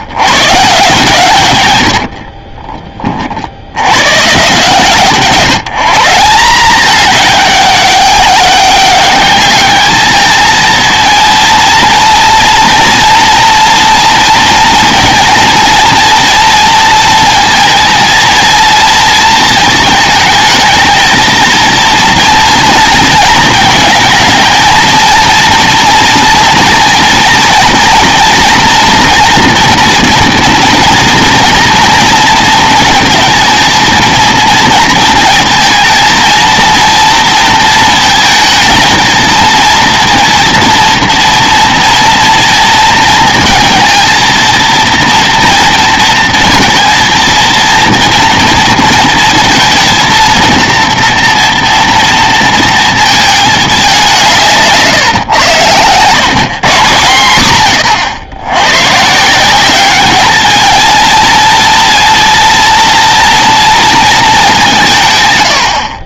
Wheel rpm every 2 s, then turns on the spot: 140, 40, 150, 200, 200, 220, 230, 230, 230, 230, 220, 230, 230, 230, 230, 230, 220, 220, 230, 230, 230, 230, 230, 230, 230, 230, 230, 150, 140, 100, 220, 230, 180.
2-4 54-56